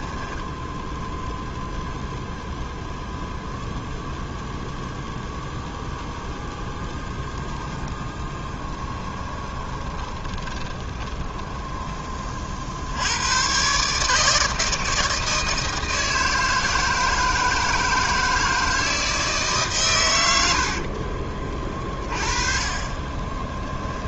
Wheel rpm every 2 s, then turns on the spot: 0, 0, 0, 0, 20, 10, 80, 160, 160, 160, 40, 20.
8-12 20-24